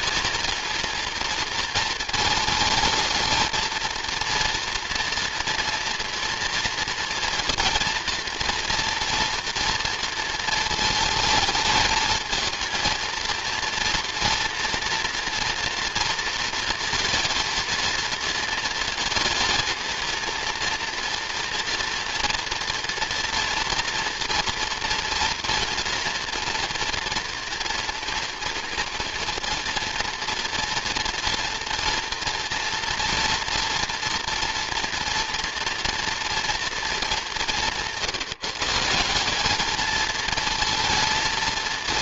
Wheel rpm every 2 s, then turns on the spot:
230, 220, 230, 230, 240, 220, 230, 230, 230, 230, 230, 230, 230, 230, 230, 230, 230, 230, 230, 170, 230.
none